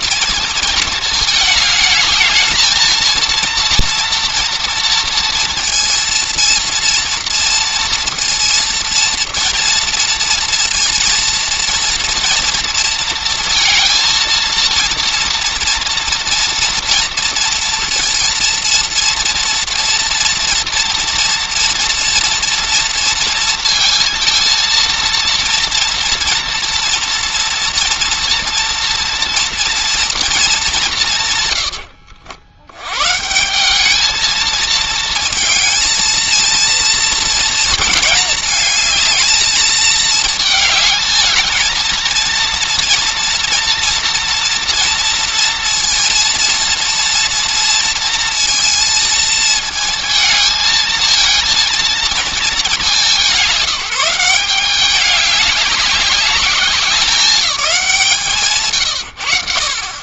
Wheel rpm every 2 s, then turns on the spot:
220, 220, 230, 230, 230, 230, 230, 230, 230, 230, 240, 240, 230, 240, 240, 180, 90, 220, 230, 220, 210, 230, 230, 230, 230, 220, 190, 190, 200, 120.
58-60